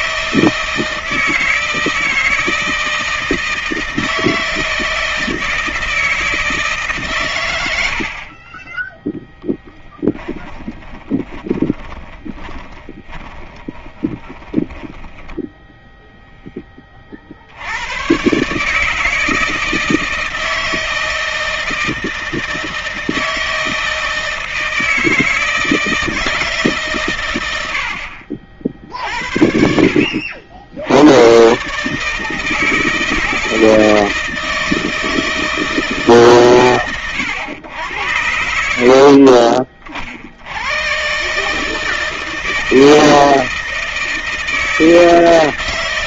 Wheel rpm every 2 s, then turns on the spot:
160, 160, 160, 140, 20, 20, 10, 10, 40, 150, 160, 160, 160, 120, 60, 100, 160, 160, 110, 50, 120, 160, 160.
8-14